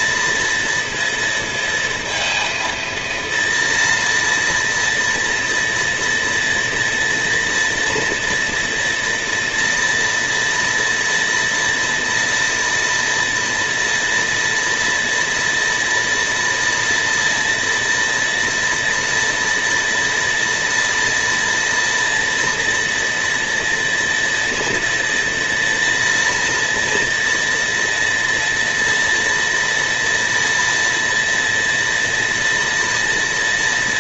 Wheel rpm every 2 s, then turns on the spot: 230, 230, 230, 230, 230, 230, 230, 230, 240, 230, 230, 230, 230, 230, 230, 230, 230.
none